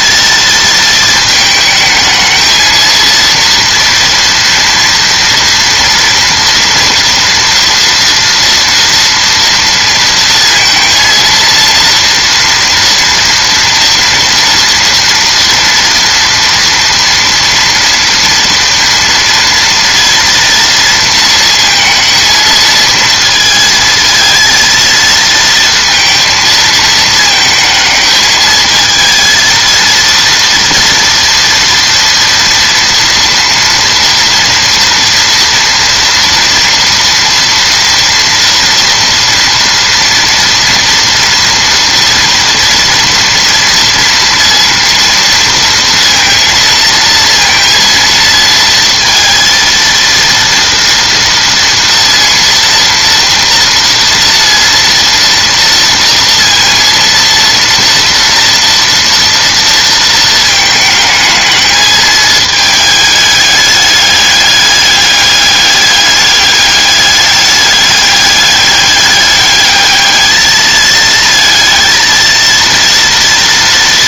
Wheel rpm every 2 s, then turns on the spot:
220, 220, 230, 230, 230, 230, 230, 240, 240, 230, 230, 220, 230, 220, 220, 230, 230, 230, 230, 230, 230, 230, 230, 230, 230, 230, 230, 230, 230, 230, 220, 210, 200, 200, 200, 220, 230.
none